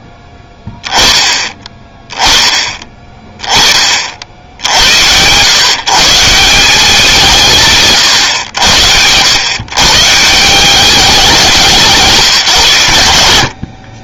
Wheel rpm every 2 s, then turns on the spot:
10, 30, 100, 180, 90, 190, 90.
none